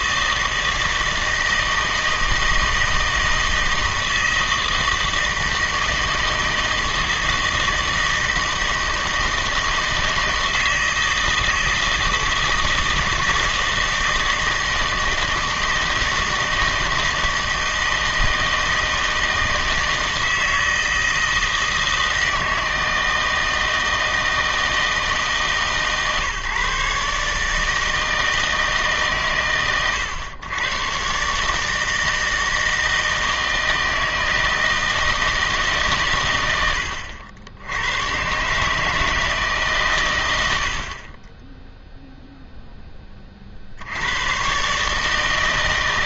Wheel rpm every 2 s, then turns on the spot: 160, 160, 160, 160, 160, 160, 160, 160, 160, 160, 160, 160, 160, 140, 150, 120, 160, 160, 90, 150, 70, 10, 140.
none